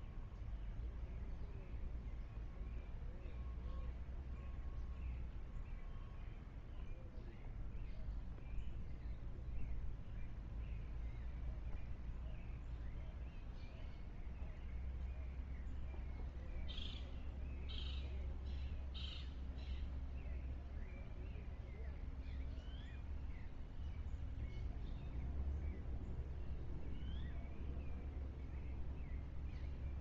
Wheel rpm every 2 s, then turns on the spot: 0, 0, 0, 0, 0, 0, 0, 0, 0, 0, 0, 0, 0, 0, 0.
none